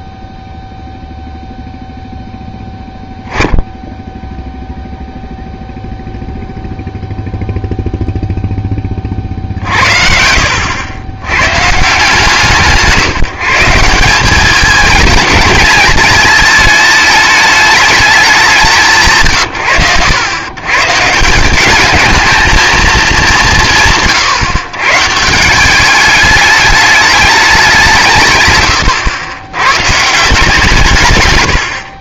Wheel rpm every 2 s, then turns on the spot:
0, 10, 0, 0, 20, 80, 170, 210, 220, 180, 140, 230, 130, 210, 130, 150.
none